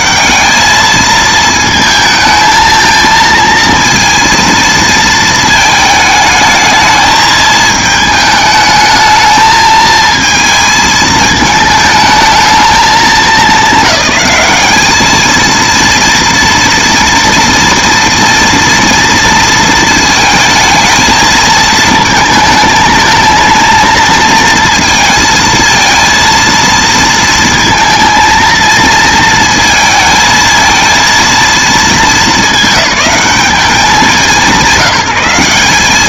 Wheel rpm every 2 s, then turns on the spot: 220, 220, 230, 220, 210, 220, 220, 210, 230, 240, 220, 220, 230, 230, 220, 220, 210, 180.
none